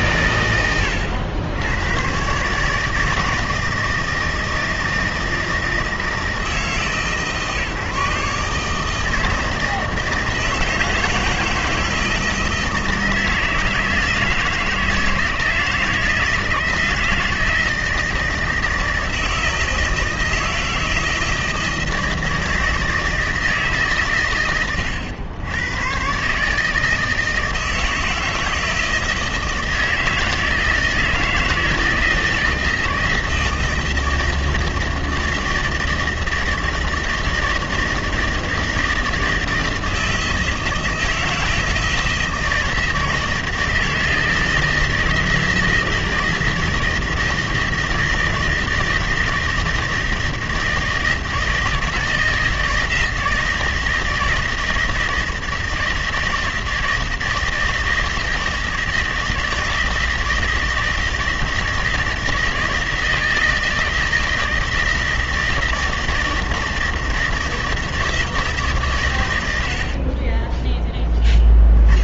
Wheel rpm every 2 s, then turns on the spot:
90, 160, 160, 150, 160, 160, 160, 160, 160, 160, 160, 160, 110, 150, 160, 160, 160, 160, 160, 160, 160, 160, 160, 160, 160, 160, 160, 160, 160, 160, 160, 160, 160, 160, 150, 20.
70-72